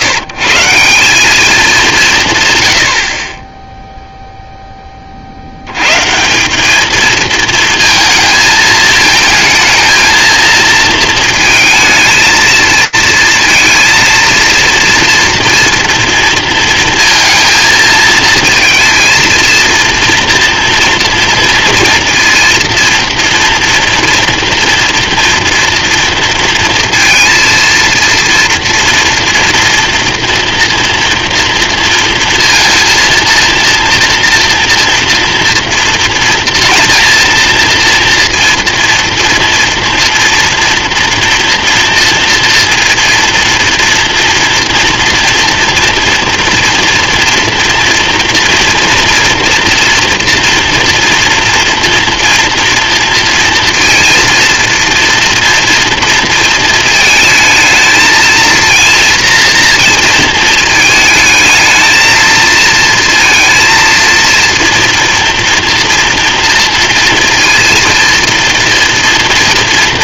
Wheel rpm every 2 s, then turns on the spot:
150, 120, 0, 190, 220, 230, 220, 230, 230, 230, 230, 230, 230, 230, 230, 230, 230, 230, 230, 230, 230, 230, 240, 230, 230, 230, 240, 230, 230, 230, 230, 220, 230, 230, 230.
none